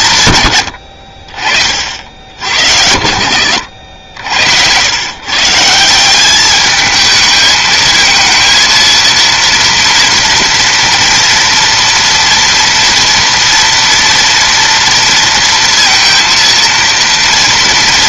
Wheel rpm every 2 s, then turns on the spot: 90, 70, 110, 210, 230, 230, 230, 230, 230.
none